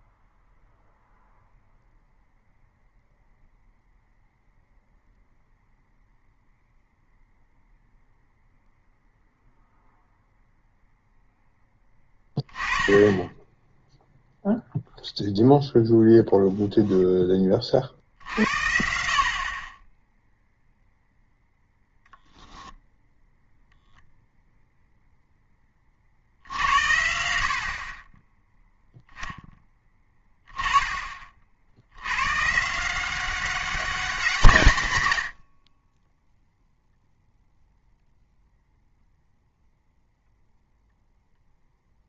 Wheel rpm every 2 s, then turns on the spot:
0, 0, 0, 0, 0, 0, 10, 0, 10, 70, 0, 0, 0, 80, 0, 20, 160, 140, 0, 0, 0.
none